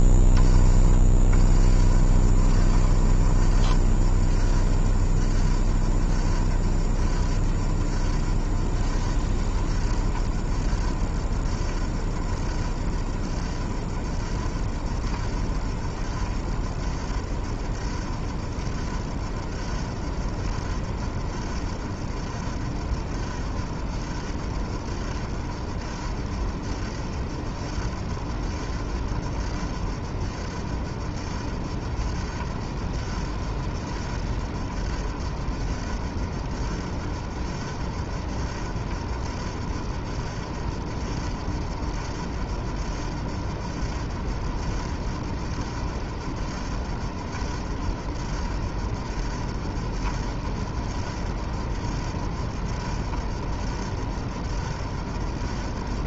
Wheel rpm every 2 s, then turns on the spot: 20, 40, 30, 30, 30, 30, 30, 30, 30, 30, 30, 30, 30, 30, 30, 30, 30, 30, 30, 30, 30, 30, 30, 30, 30, 30, 30, 30.
0-4